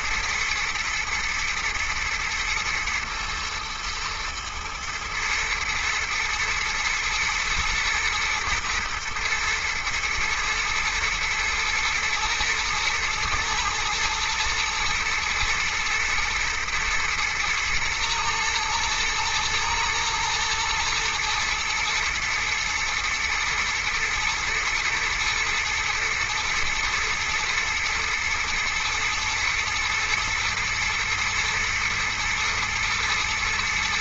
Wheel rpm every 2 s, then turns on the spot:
110, 120, 120, 110, 120, 110, 110, 110, 120, 120, 120, 110, 120, 110, 110, 120, 110.
none